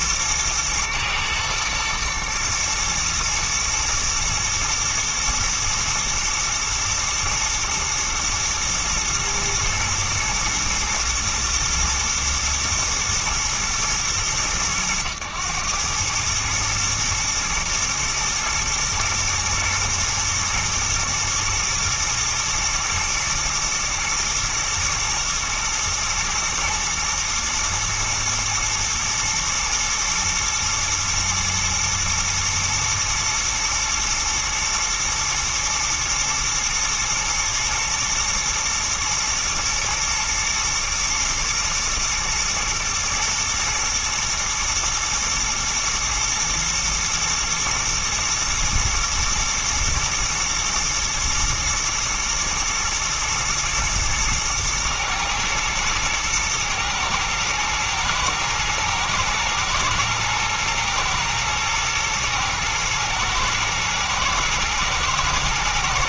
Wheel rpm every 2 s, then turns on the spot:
120, 120, 110, 120, 110, 110, 120, 100, 110, 120, 120, 110, 120, 110, 110, 110, 110, 110, 120, 120, 120, 110, 120, 110, 120, 110, 110, 110, 110, 110, 110, 110, 110.
none